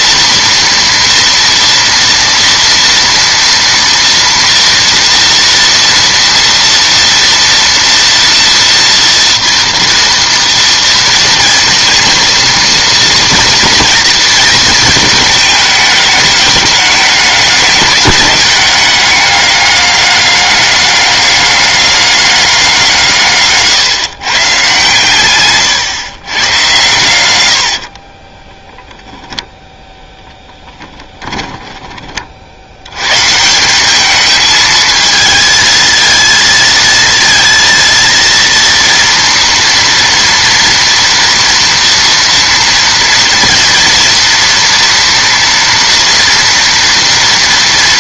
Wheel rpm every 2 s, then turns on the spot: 230, 230, 230, 230, 230, 230, 230, 220, 210, 200, 200, 180, 140, 120, 10, 20, 80, 220, 230, 230, 240, 230, 230, 230.
28-32